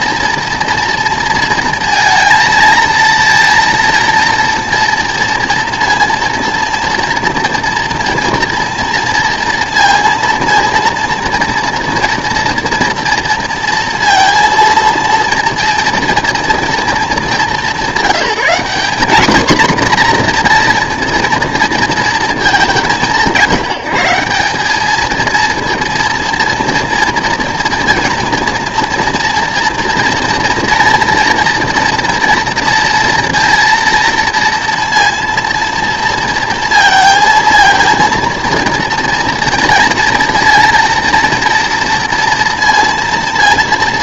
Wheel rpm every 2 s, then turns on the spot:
230, 220, 230, 230, 230, 230, 230, 230, 230, 200, 240, 200, 190, 230, 230, 230, 230, 230, 230, 230, 230, 230.
none